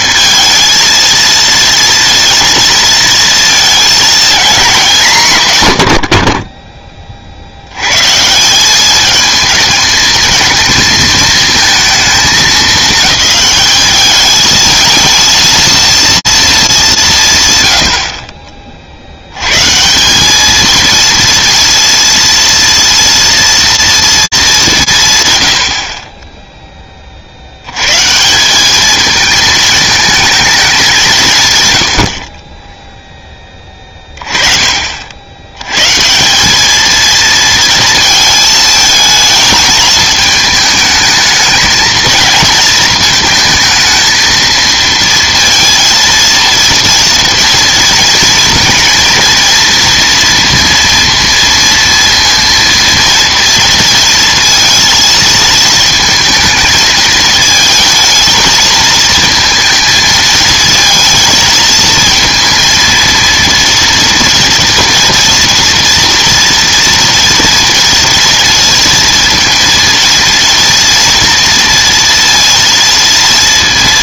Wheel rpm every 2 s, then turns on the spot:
230, 230, 220, 20, 190, 220, 210, 220, 210, 40, 220, 230, 180, 20, 210, 210, 20, 40, 210, 220, 210, 230, 220, 230, 230, 230, 230, 230, 220, 220, 220, 230, 230, 230, 230, 230, 230.
none